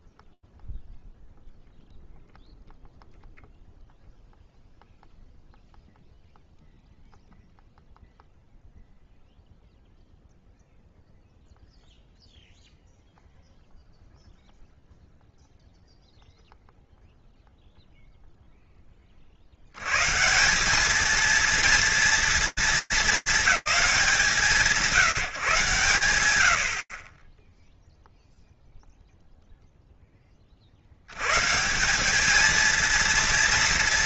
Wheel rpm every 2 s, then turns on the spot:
0, 0, 0, 0, 0, 0, 0, 0, 0, 60, 230, 210, 160, 10, 0, 130, 230.
none